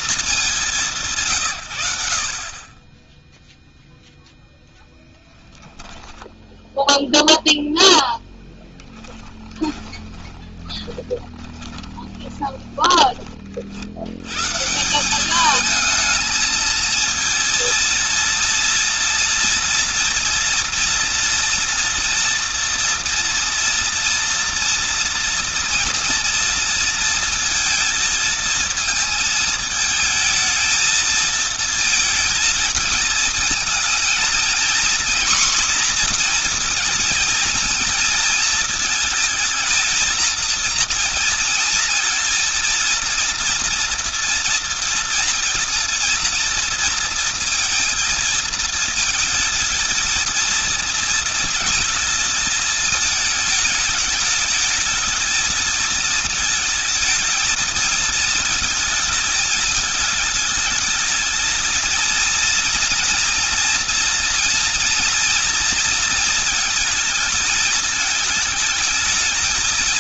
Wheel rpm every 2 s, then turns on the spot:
170, 20, 10, 0, 10, 10, 20, 160, 230, 230, 230, 230, 230, 230, 220, 220, 220, 230, 230, 220, 230, 230, 240, 230, 230, 230, 220, 210, 220, 220, 220, 240, 230, 220, 210.
8-12